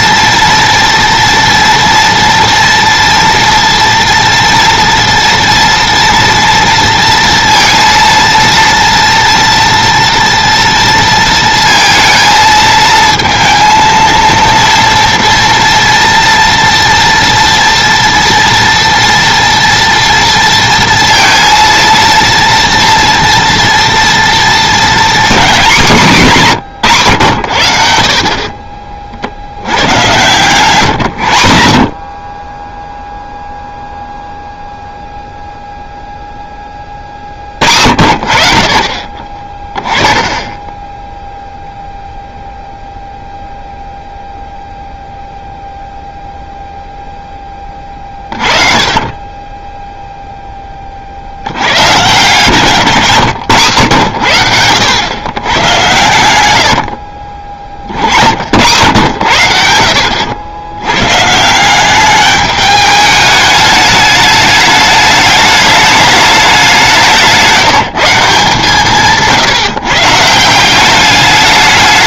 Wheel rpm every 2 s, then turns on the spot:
230, 230, 230, 230, 230, 230, 220, 230, 230, 230, 230, 230, 230, 170, 40, 140, 20, 0, 10, 60, 20, 0, 0, 0, 30, 20, 140, 100, 70, 80, 90, 210, 210, 210, 160, 170.
28-30 52-54 56-58